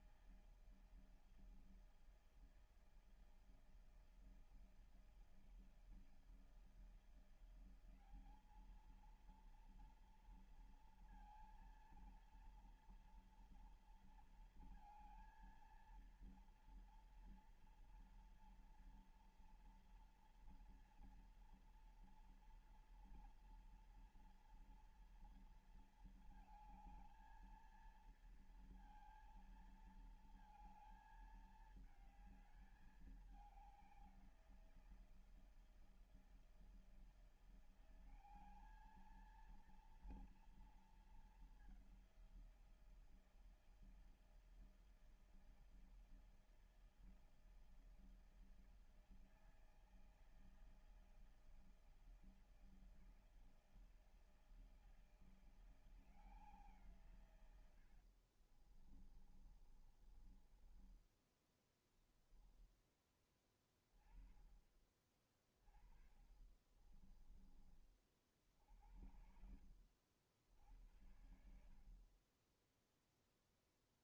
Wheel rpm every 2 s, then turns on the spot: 160, 160, 160, 160, 200, 230, 230, 230, 230, 230, 230, 230, 230, 220, 230, 230, 210, 180, 160, 190, 230, 190, 160, 160, 160, 160, 160, 160, 170, 60, 30, 10, 20, 30, 40, 80, 40.
58-62 66-68 72-74